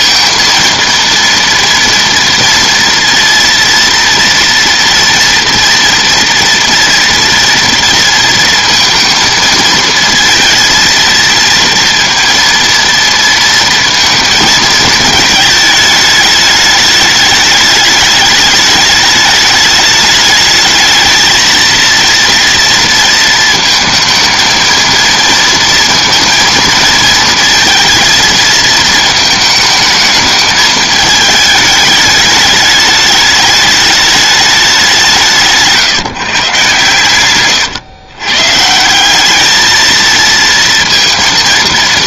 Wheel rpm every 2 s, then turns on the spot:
230, 230, 230, 230, 230, 230, 230, 220, 210, 210, 220, 230, 230, 230, 220, 220, 210, 190, 130, 170, 220.
none